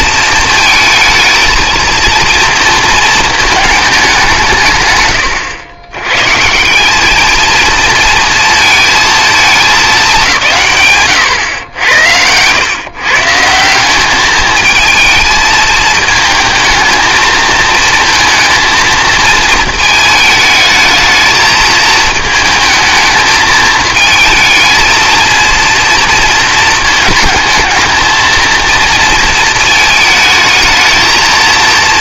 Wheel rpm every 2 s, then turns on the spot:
220, 230, 150, 180, 230, 130, 110, 220, 230, 230, 220, 220, 220, 220, 230, 220.
none